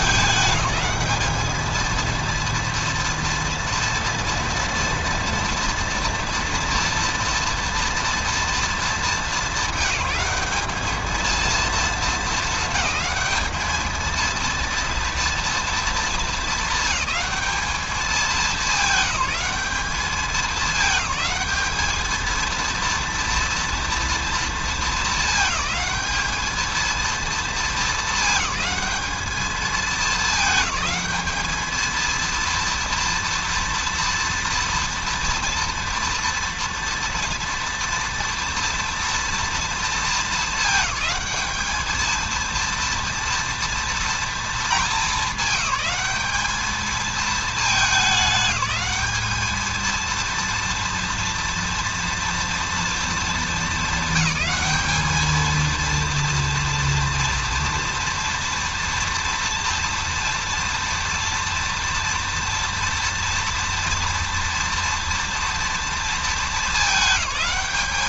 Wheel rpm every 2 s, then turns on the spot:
210, 240, 230, 230, 220, 200, 220, 230, 220, 200, 210, 230, 220, 220, 210, 210, 230, 230, 230, 230, 220, 230, 230, 220, 210, 230, 230, 220, 230, 230, 240, 230, 230, 220.
none